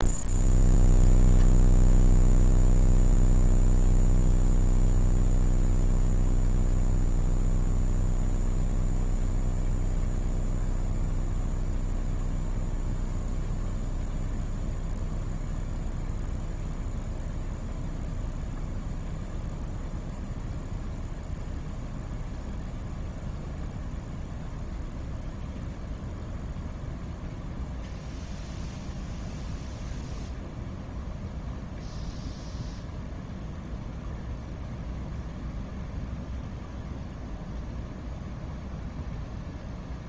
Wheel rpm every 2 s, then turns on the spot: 0, 0, 0, 0, 0, 0, 0, 0, 0, 0, 0, 0, 0, 0, 0, 0, 0, 0, 0, 0.
none